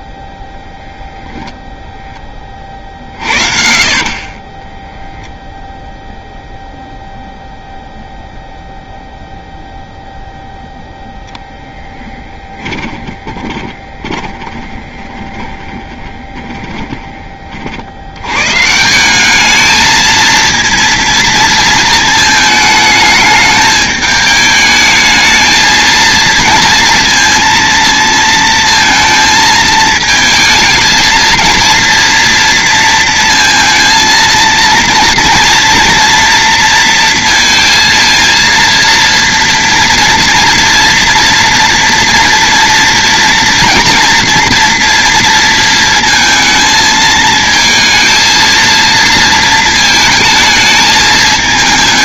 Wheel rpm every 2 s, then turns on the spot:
0, 40, 10, 0, 0, 0, 20, 10, 20, 160, 230, 220, 220, 230, 230, 220, 230, 230, 230, 230, 230, 240, 230, 220, 230, 220.
4-6 12-18